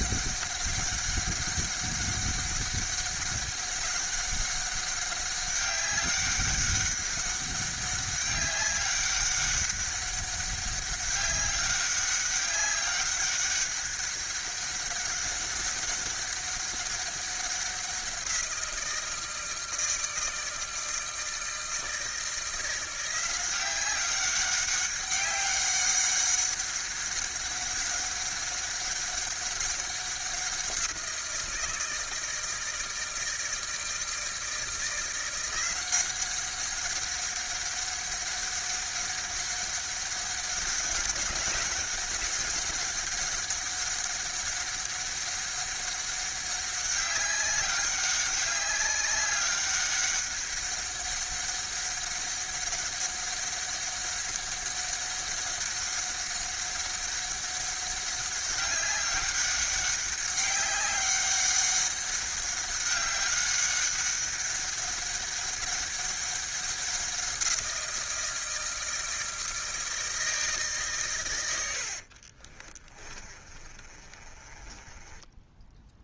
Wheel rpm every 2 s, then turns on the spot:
200, 200, 190, 200, 200, 200, 190, 200, 190, 170, 160, 170, 190, 190, 200, 180, 160, 160, 190, 190, 190, 190, 190, 200, 200, 200, 190, 200, 200, 190, 190, 200, 200, 190, 160, 150, 30, 20.
72-76